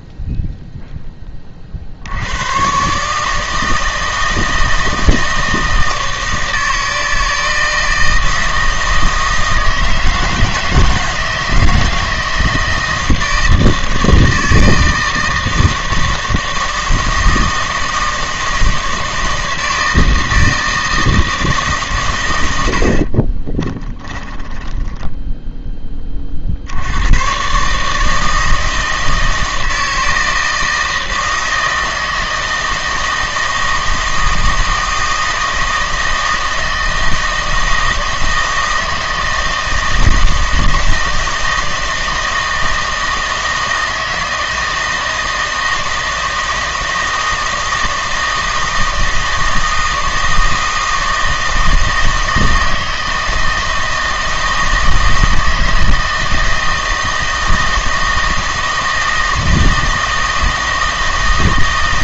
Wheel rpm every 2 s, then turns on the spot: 0, 120, 160, 160, 160, 160, 160, 160, 160, 160, 160, 80, 10, 60, 160, 160, 160, 160, 160, 160, 160, 160, 160, 160, 160, 160, 160, 160, 160, 160, 160.
none